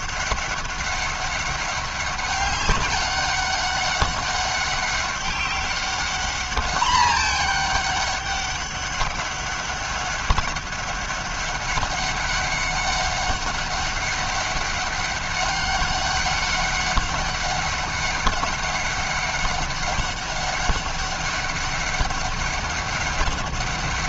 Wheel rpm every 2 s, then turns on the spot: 200, 200, 200, 210, 200, 200, 200, 190, 200, 190, 190, 190.
none